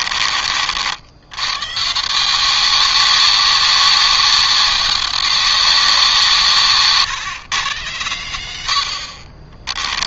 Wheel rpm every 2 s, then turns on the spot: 70, 200, 200, 150, 60.
none